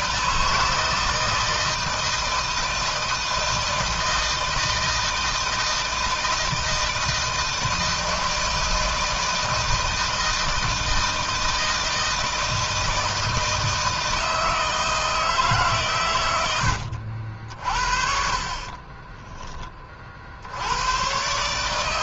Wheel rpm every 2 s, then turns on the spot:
160, 160, 160, 160, 160, 160, 160, 160, 80, 30, 110.
18-20